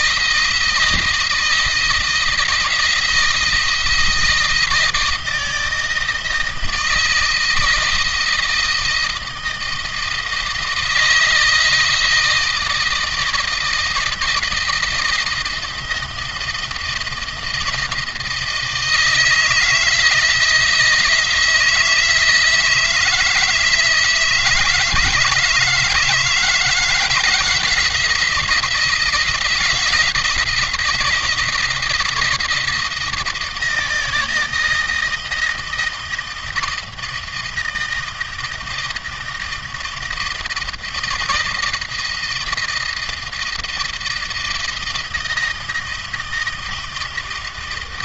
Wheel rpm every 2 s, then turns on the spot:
160, 160, 160, 160, 160, 160, 160, 160, 170, 160, 160, 160, 160, 160, 170, 170, 160, 160, 160, 160, 170, 170, 160, 160.
none